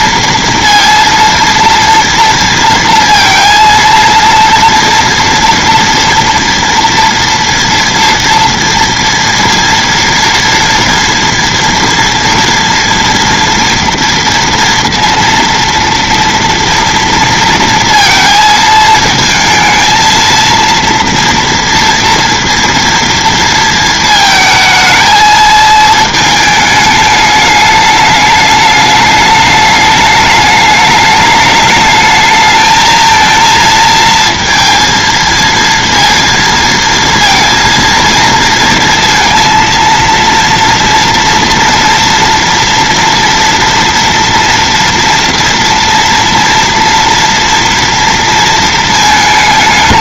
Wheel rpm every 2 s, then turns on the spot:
230, 230, 230, 230, 230, 240, 230, 230, 230, 230, 230, 230, 220, 210, 210, 210, 220, 230, 220, 230, 230, 230, 230, 230, 220.
none